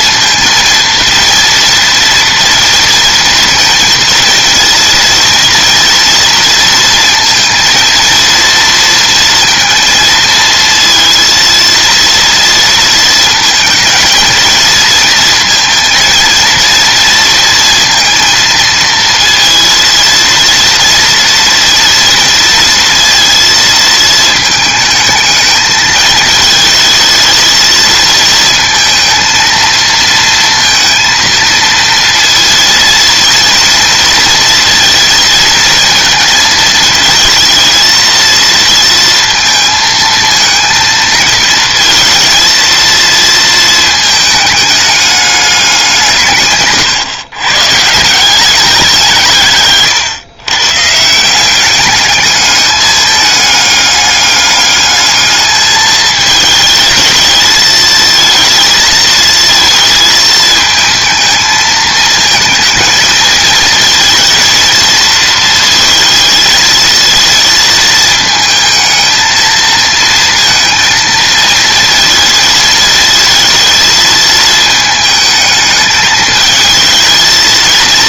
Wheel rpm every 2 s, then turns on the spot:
230, 230, 230, 230, 230, 230, 230, 230, 230, 230, 230, 230, 220, 220, 230, 230, 230, 230, 220, 230, 220, 230, 210, 120, 180, 150, 210, 210, 220, 220, 220, 220, 230, 230, 220, 230, 230, 220, 220.
none